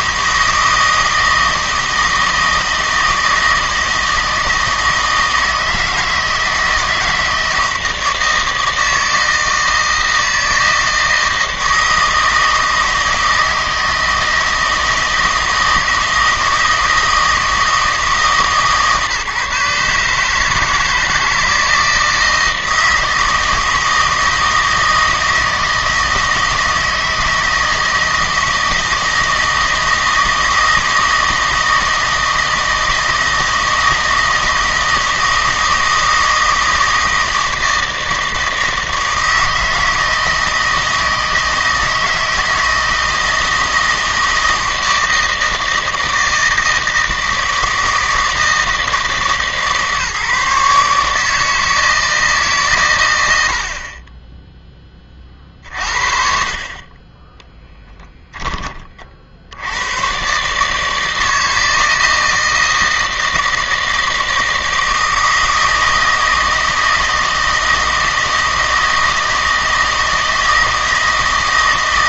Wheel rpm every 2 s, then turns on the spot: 160, 160, 160, 160, 160, 160, 160, 160, 160, 140, 160, 160, 160, 160, 160, 160, 160, 160, 160, 160, 160, 160, 160, 160, 160, 150, 130, 20, 20, 30, 150, 160, 160, 160, 160, 160.
none